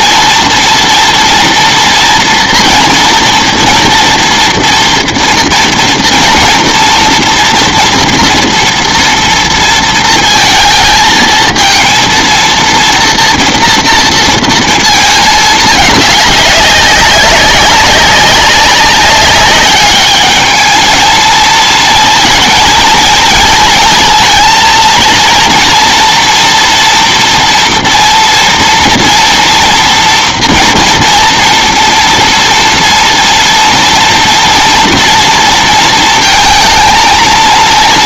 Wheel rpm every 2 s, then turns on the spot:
230, 240, 230, 230, 230, 230, 230, 220, 200, 200, 220, 230, 230, 230, 230, 230, 230, 230, 230.
none